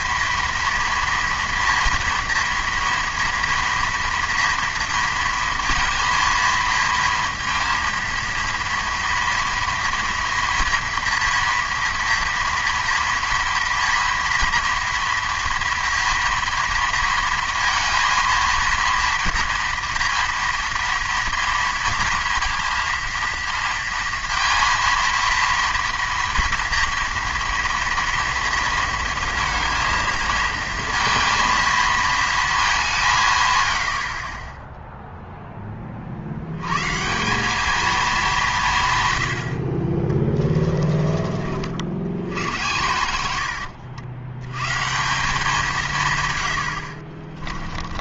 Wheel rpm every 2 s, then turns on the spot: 230, 230, 230, 230, 230, 240, 230, 230, 230, 230, 230, 230, 230, 230, 230, 230, 190, 10, 120, 150, 30, 90, 140, 70.
40-42 46-48